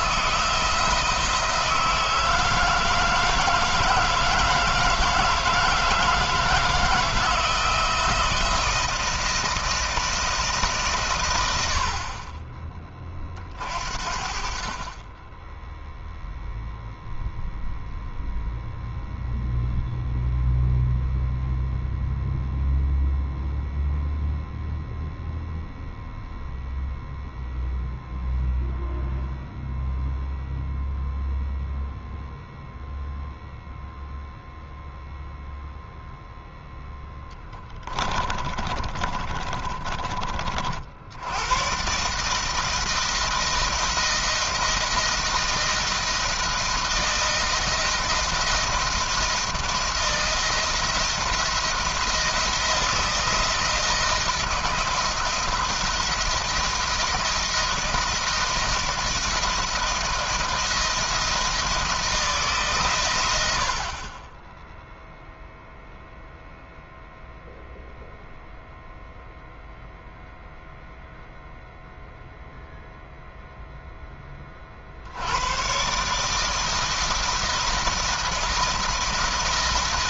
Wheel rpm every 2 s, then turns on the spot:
160, 160, 160, 160, 160, 140, 30, 40, 0, 0, 0, 0, 0, 0, 0, 0, 0, 0, 0, 30, 60, 160, 160, 170, 160, 170, 170, 170, 160, 160, 160, 130, 0, 0, 0, 0, 0, 50, 160, 170.
38-40